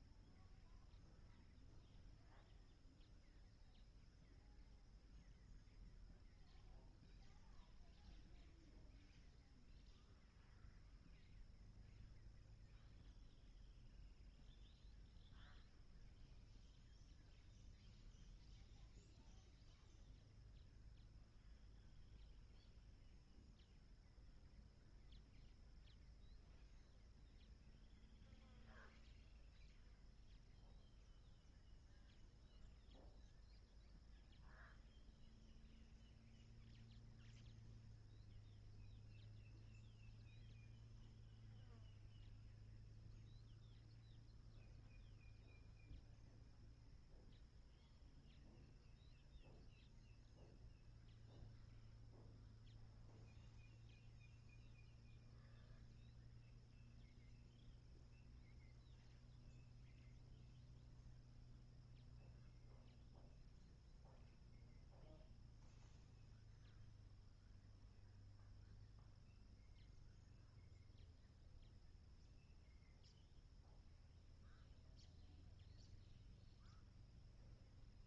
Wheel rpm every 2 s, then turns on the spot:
0, 0, 0, 0, 0, 0, 0, 0, 0, 0, 0, 0, 0, 0, 0, 0, 0, 0, 0, 0, 0, 0, 0, 0, 0, 0, 0, 0, 0, 0, 0, 0, 0, 0, 0, 0, 0, 0, 0.
none